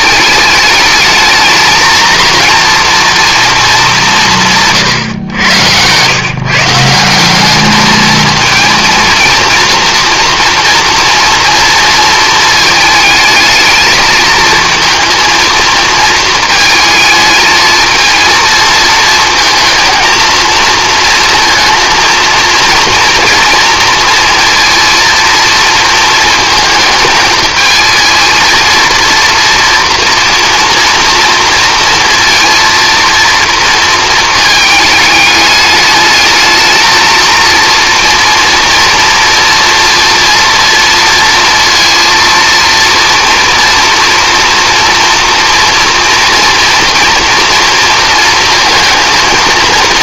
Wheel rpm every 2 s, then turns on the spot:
210, 240, 150, 170, 230, 230, 220, 230, 220, 220, 230, 240, 230, 220, 230, 240, 230, 220, 220, 230, 230, 230, 230, 230, 230.
none